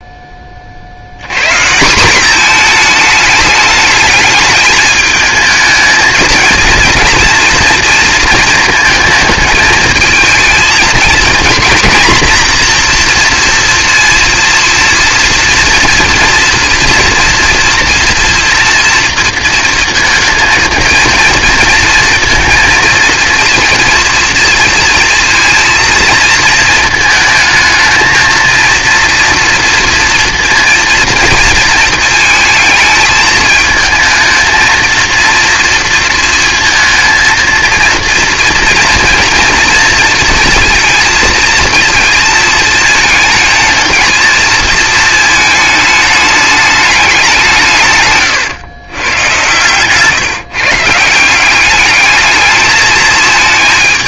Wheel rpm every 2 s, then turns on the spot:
40, 220, 210, 230, 230, 230, 240, 230, 240, 230, 230, 230, 230, 220, 230, 230, 220, 230, 230, 230, 230, 220, 220, 210, 110, 150, 220.
none